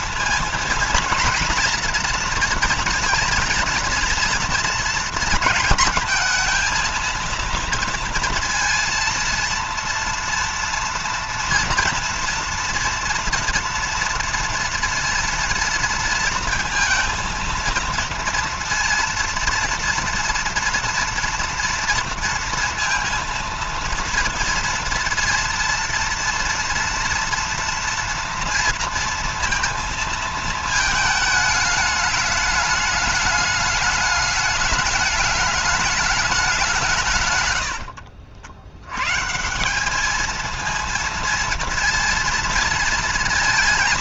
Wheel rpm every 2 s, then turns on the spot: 230, 230, 230, 230, 230, 230, 230, 230, 220, 230, 230, 230, 230, 230, 230, 220, 210, 210, 170, 110, 230, 230.
none